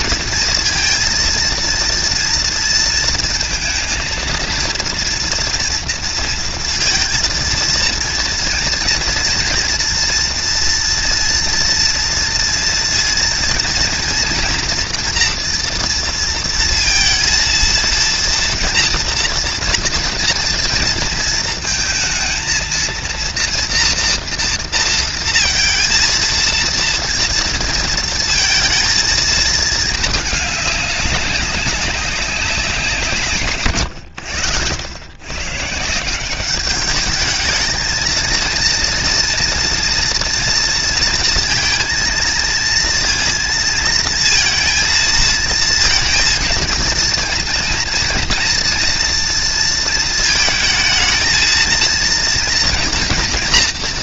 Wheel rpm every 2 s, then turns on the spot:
230, 230, 230, 230, 230, 240, 230, 240, 230, 230, 230, 230, 230, 230, 230, 200, 180, 100, 200, 230, 230, 230, 230, 230, 230, 220, 230.
none